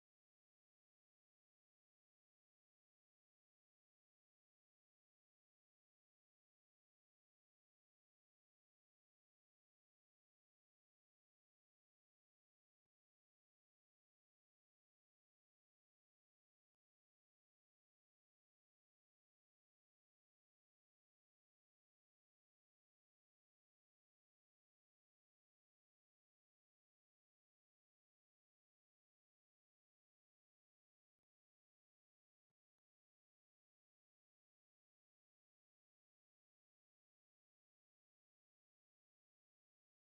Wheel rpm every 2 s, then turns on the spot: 0, 0, 0, 0, 0, 0, 0, 0, 0, 0, 0, 0, 0, 0, 0, 0, 0, 0, 0, 0.
none